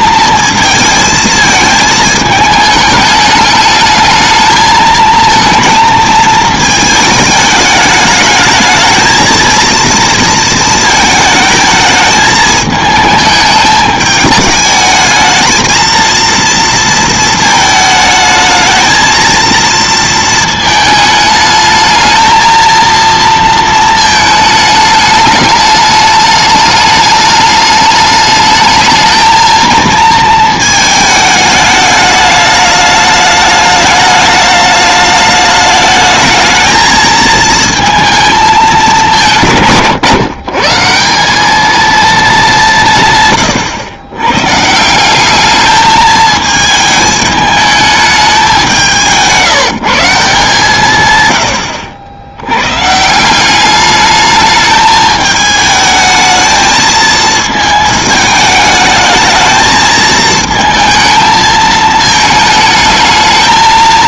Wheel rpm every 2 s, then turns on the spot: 230, 210, 220, 220, 220, 220, 220, 210, 230, 220, 220, 230, 220, 210, 220, 220, 210, 210, 220, 210, 150, 180, 150, 220, 180, 150, 100, 210, 220, 210, 220, 220.
none